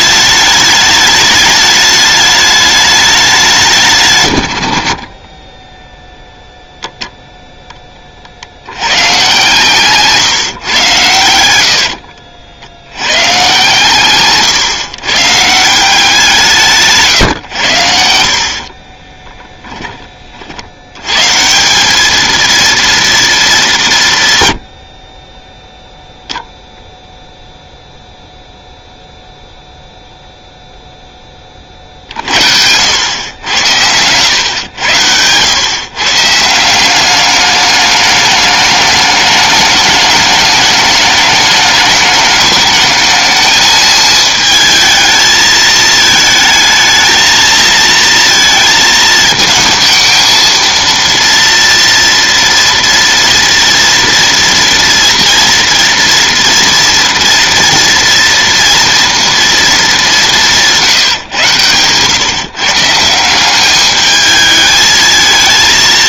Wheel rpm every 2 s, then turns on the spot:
210, 210, 100, 0, 80, 140, 70, 130, 170, 40, 70, 230, 110, 10, 0, 0, 80, 100, 170, 210, 210, 210, 220, 220, 230, 230, 230, 230, 230, 230, 170, 140, 220.
18-20